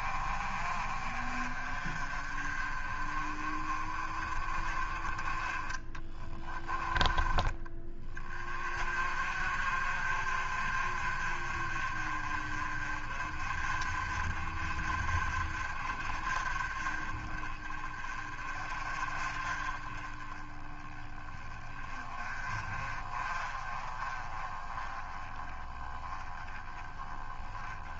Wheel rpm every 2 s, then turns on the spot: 40, 30, 20, 20, 40, 40, 40, 40, 30, 30, 20, 30, 20, 20.
none